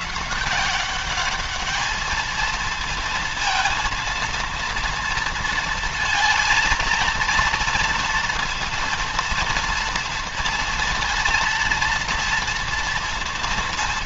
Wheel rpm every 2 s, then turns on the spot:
200, 230, 230, 230, 240, 230, 230.
none